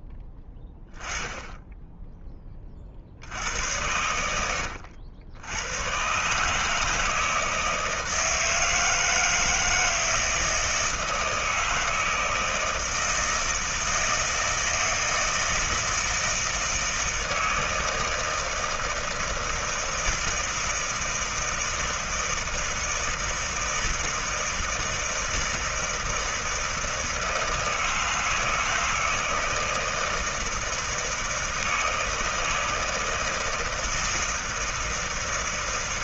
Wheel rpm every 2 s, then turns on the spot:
10, 50, 100, 160, 160, 160, 160, 160, 160, 160, 160, 160, 160, 160, 160, 160, 160, 160.
none